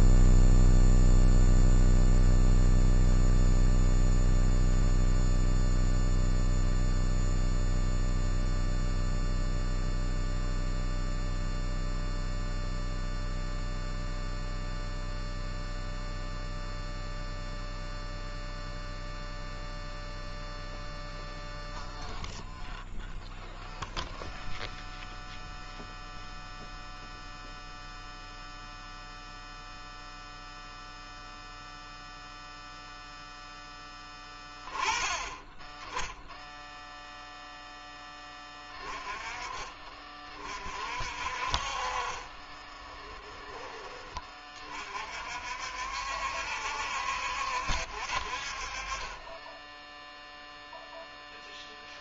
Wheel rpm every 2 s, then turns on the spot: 0, 0, 0, 0, 0, 0, 0, 0, 0, 0, 0, 0, 0, 0, 0, 0, 0, 20, 0, 20, 40, 20, 40, 70, 50, 0.
42-44